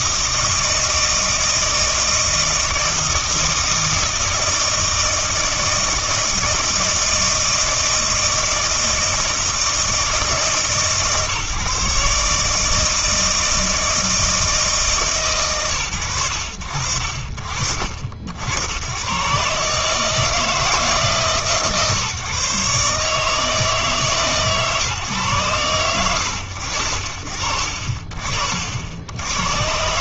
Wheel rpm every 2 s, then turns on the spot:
160, 160, 160, 160, 160, 150, 150, 160, 70, 90, 160, 140, 140, 90, 80.
none